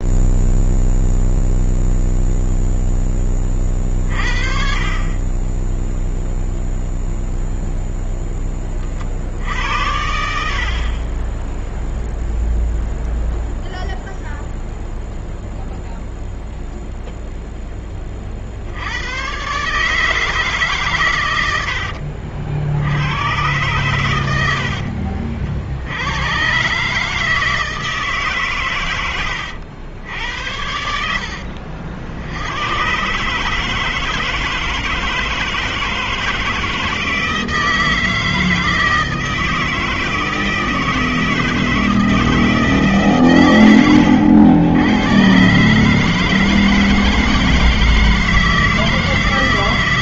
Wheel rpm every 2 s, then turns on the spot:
0, 0, 30, 0, 20, 60, 0, 0, 0, 50, 150, 70, 80, 110, 140, 80, 90, 160, 160, 160, 160, 160, 80, 160, 160.
10-12 24-26